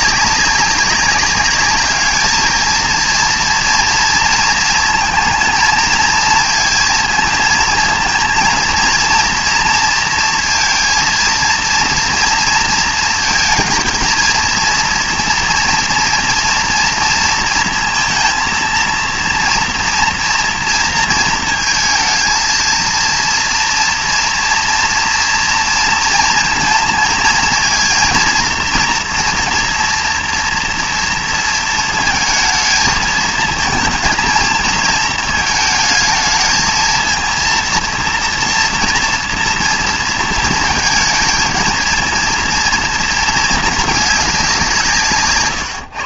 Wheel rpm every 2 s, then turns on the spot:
190, 230, 230, 230, 230, 230, 230, 230, 230, 230, 230, 230, 230, 230, 230, 240, 220, 220, 220, 230, 220, 220, 180.
none